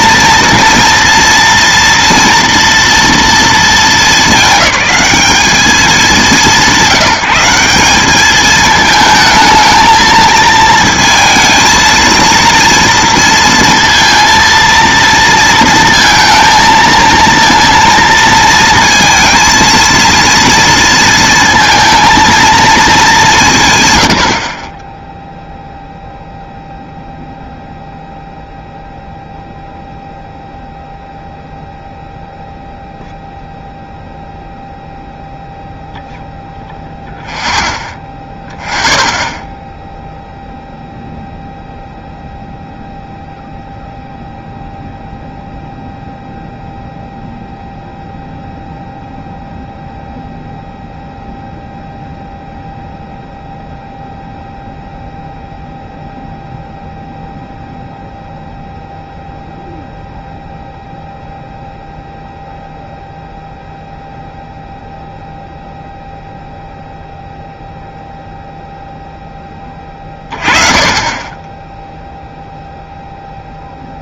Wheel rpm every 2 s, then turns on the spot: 230, 230, 210, 190, 220, 220, 230, 230, 230, 230, 230, 230, 30, 0, 0, 0, 0, 0, 0, 0, 0, 0, 0, 0, 0, 0, 0, 0, 0, 0, 0, 0, 0, 0, 0, 30, 0.
none